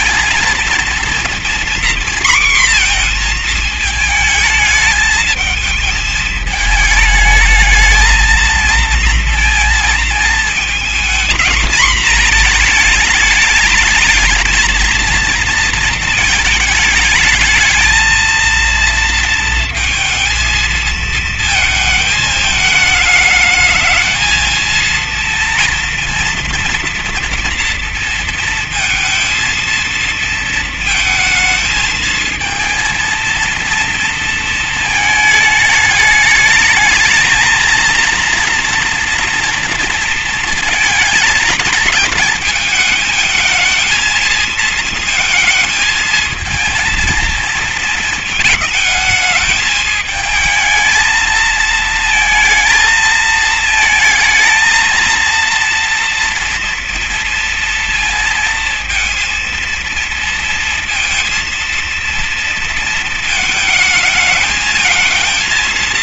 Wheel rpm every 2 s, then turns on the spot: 230, 240, 220, 220, 230, 230, 220, 220, 230, 230, 230, 210, 220, 230, 230, 220, 220, 220, 220, 240, 230, 220, 230, 220, 220, 220, 220, 230, 230, 230, 230, 230, 230.
none